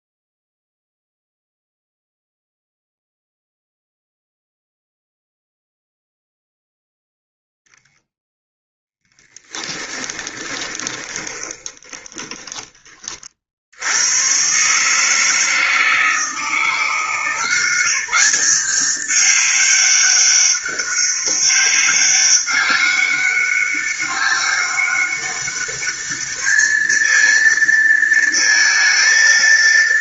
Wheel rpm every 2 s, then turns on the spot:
0, 0, 0, 0, 0, 20, 30, 140, 160, 190, 200, 200, 200, 220, 230.
10-12